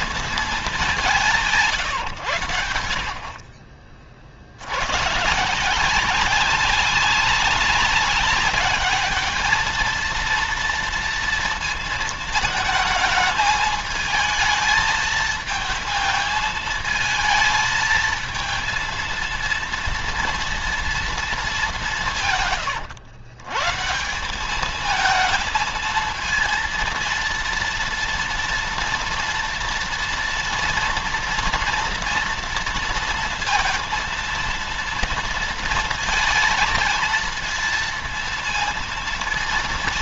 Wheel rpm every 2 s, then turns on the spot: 190, 70, 100, 190, 210, 230, 220, 220, 220, 230, 230, 120, 220, 230, 230, 230, 230, 230, 230, 230.
none